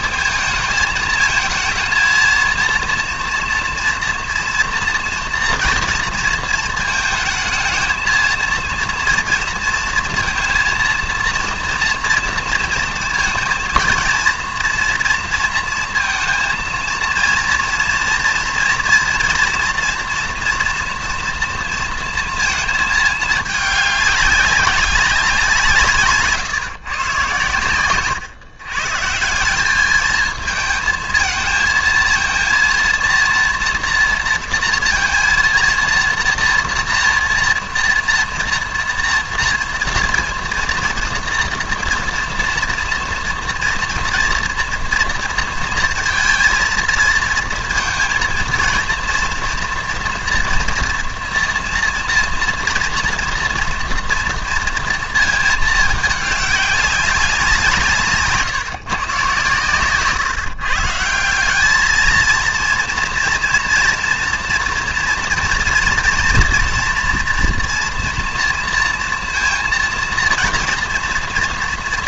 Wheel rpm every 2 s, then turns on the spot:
220, 230, 230, 230, 230, 230, 230, 230, 230, 230, 240, 230, 200, 150, 130, 220, 230, 230, 230, 230, 230, 230, 230, 230, 230, 240, 230, 230, 200, 150, 150, 230, 240, 240, 230, 230.
none